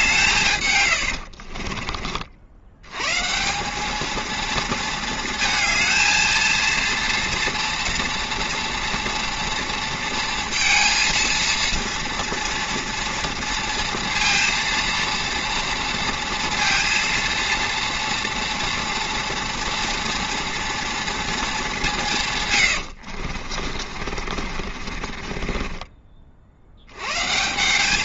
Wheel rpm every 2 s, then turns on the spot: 130, 80, 230, 230, 230, 230, 230, 230, 230, 230, 240, 100, 40, 70.
22-26